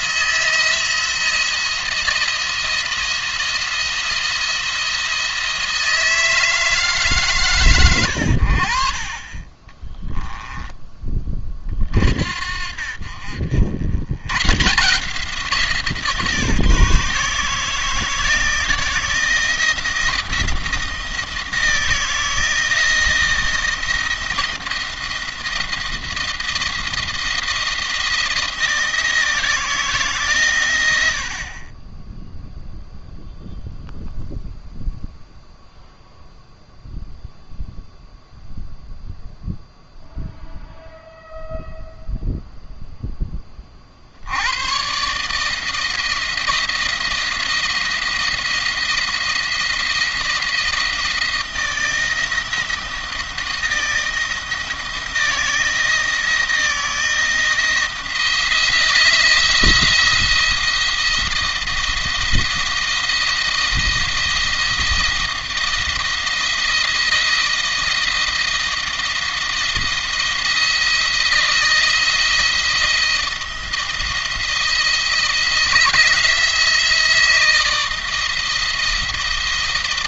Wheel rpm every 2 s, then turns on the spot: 160, 170, 170, 160, 60, 20, 50, 150, 150, 160, 170, 160, 170, 170, 160, 100, 0, 0, 0, 0, 0, 0, 110, 170, 170, 160, 160, 160, 160, 170, 170, 160, 170, 170, 170, 160, 170, 170, 160, 170.
none